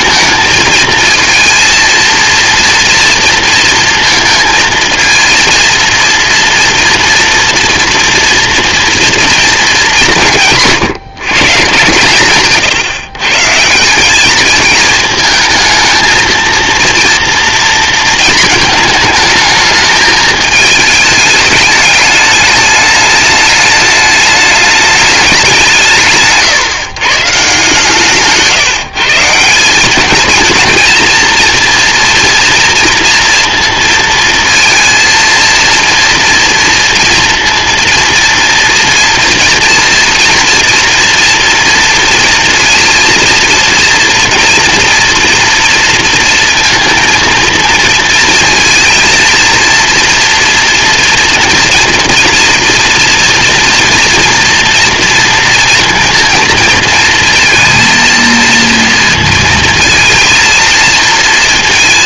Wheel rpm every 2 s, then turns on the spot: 220, 230, 230, 230, 230, 140, 140, 220, 230, 220, 210, 210, 210, 140, 150, 230, 230, 230, 230, 230, 240, 230, 240, 230, 230, 240, 230, 230, 230, 230, 230.
none